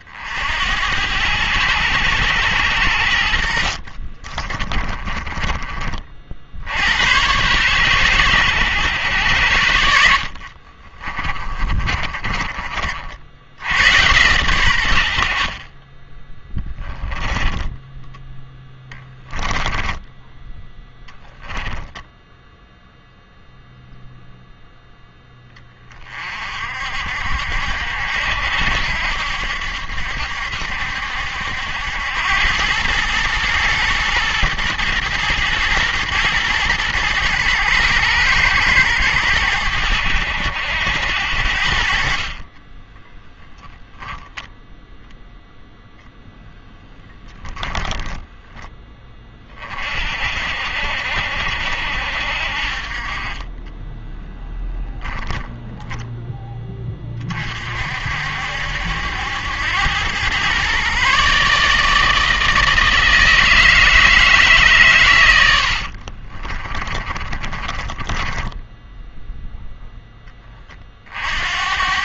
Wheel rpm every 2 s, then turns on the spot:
70, 80, 30, 80, 100, 50, 30, 100, 10, 20, 10, 0, 0, 50, 70, 70, 100, 120, 110, 110, 80, 20, 0, 10, 10, 60, 40, 10, 10, 70, 130, 160, 140, 30, 10, 30.
4-6 10-12 16-20 42-44 54-56 66-70